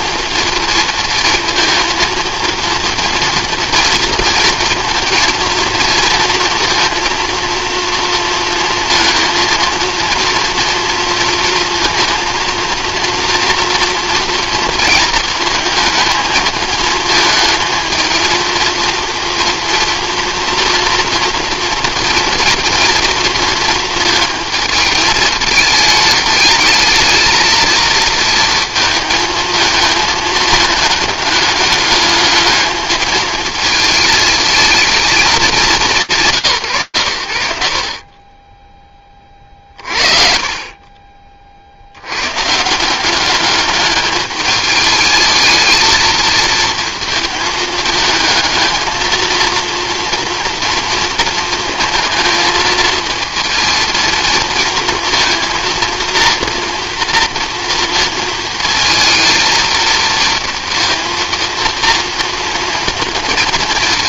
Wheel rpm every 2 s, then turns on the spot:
220, 230, 230, 230, 230, 230, 230, 230, 220, 230, 230, 240, 220, 220, 230, 220, 220, 220, 140, 20, 30, 160, 210, 230, 220, 230, 230, 230, 230, 220, 230, 230.
none